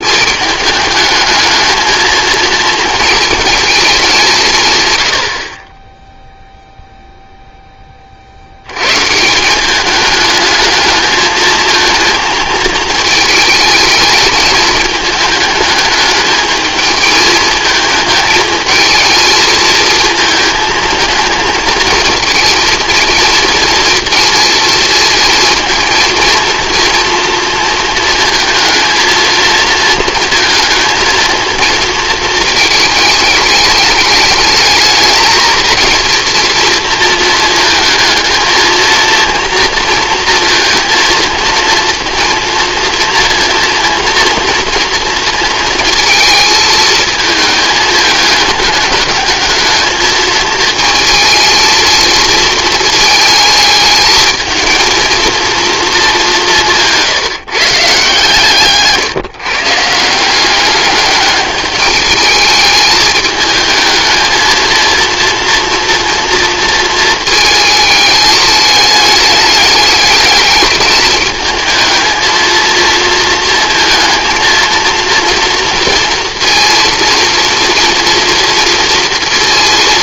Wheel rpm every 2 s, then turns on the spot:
210, 230, 140, 0, 100, 220, 220, 220, 220, 220, 220, 220, 230, 230, 230, 220, 220, 210, 230, 230, 230, 230, 230, 220, 220, 220, 230, 230, 180, 150, 200, 210, 230, 230, 210, 210, 230, 230, 230, 230.
58-60